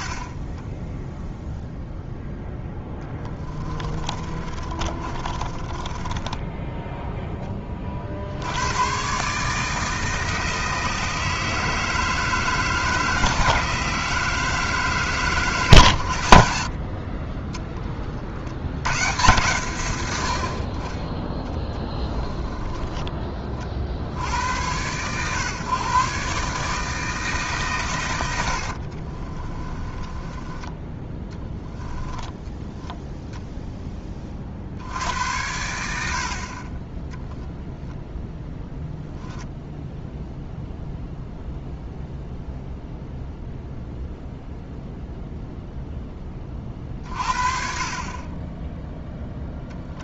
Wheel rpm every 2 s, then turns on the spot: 40, 10, 30, 10, 100, 160, 160, 160, 60, 90, 40, 20, 110, 160, 60, 20, 10, 70, 20, 10, 0, 0, 0, 40, 10.
4-8 28-32